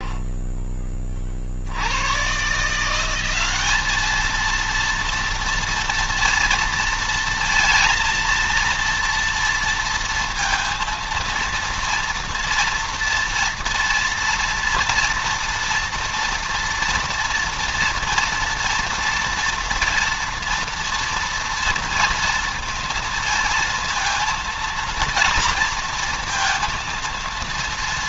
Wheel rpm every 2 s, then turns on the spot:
30, 160, 230, 230, 230, 230, 230, 230, 230, 230, 230, 230, 230, 230.
none